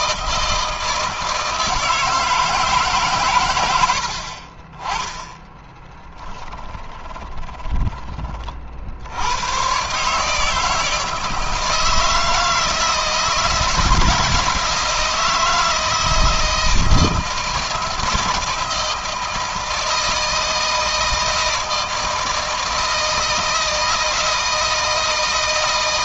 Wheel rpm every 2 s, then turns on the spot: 160, 140, 20, 20, 70, 160, 160, 160, 160, 160, 160, 160, 160.
6-8